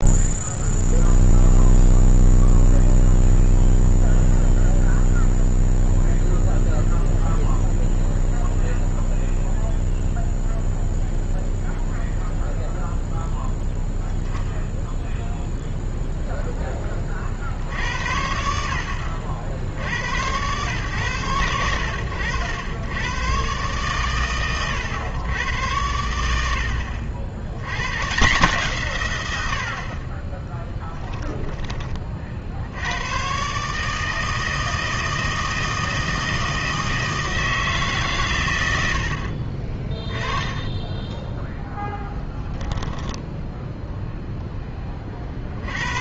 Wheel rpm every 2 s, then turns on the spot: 0, 0, 0, 0, 0, 0, 0, 0, 10, 70, 120, 100, 110, 70, 160, 20, 70, 160, 160, 100, 20, 0, 10.
30-32 40-42